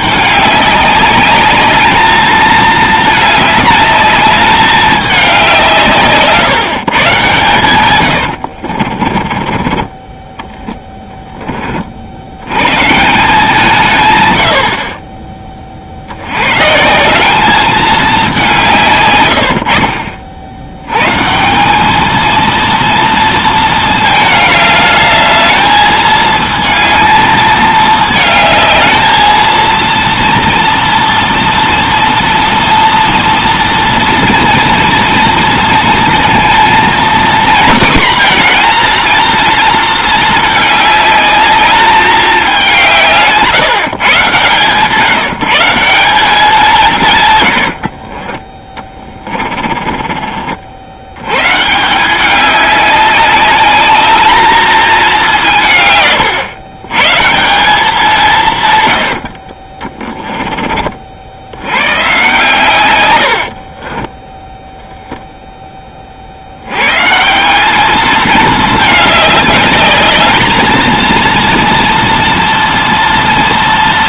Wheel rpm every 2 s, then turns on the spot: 200, 220, 210, 160, 50, 10, 140, 70, 160, 160, 110, 230, 210, 220, 220, 230, 230, 230, 240, 240, 210, 190, 140, 170, 20, 60, 200, 220, 130, 130, 30, 120, 0, 110, 210, 230, 230.
8-12 48-50